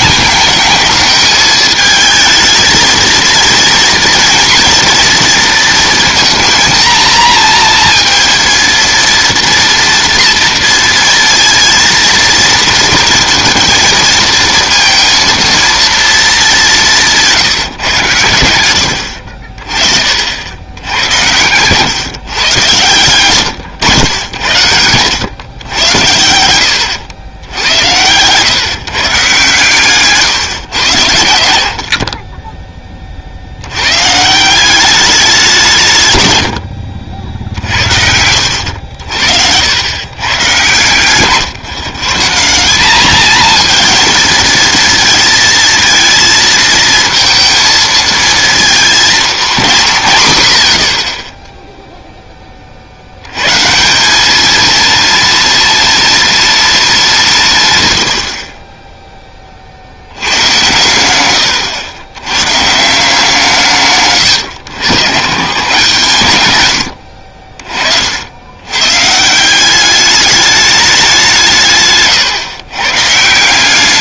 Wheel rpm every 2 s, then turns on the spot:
220, 220, 230, 230, 230, 230, 230, 230, 200, 100, 90, 130, 100, 90, 140, 130, 20, 180, 90, 80, 120, 190, 220, 230, 230, 80, 40, 230, 230, 30, 110, 140, 120, 100, 110, 210, 130.
38-40